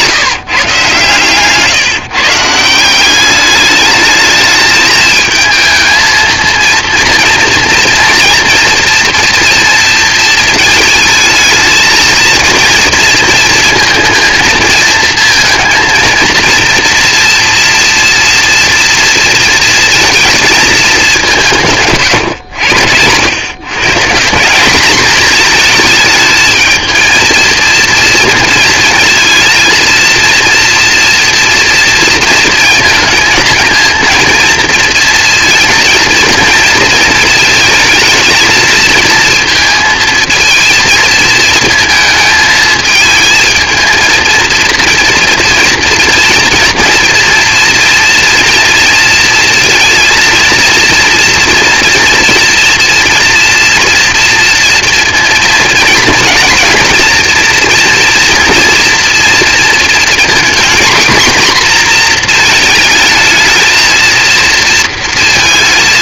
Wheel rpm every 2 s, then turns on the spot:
140, 160, 220, 230, 230, 220, 230, 230, 230, 230, 220, 100, 190, 220, 230, 230, 230, 230, 230, 220, 230, 220, 220, 230, 240, 230, 230, 240, 230, 230, 250, 220, 230.
none